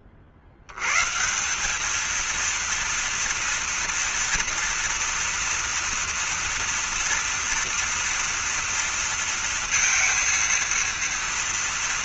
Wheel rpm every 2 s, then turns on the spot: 100, 230, 240, 240, 230, 230.
none